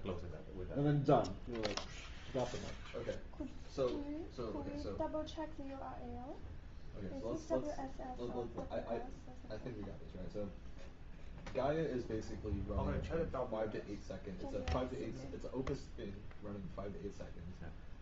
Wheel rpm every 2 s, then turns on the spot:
0, 0, 0, 0, 0, 0, 0, 0, 0.
none